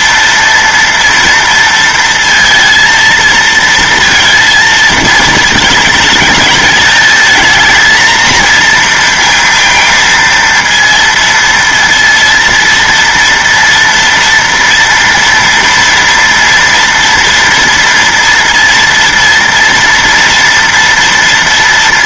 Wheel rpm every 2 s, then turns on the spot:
230, 230, 230, 220, 230, 230, 230, 230, 240, 230, 230.
none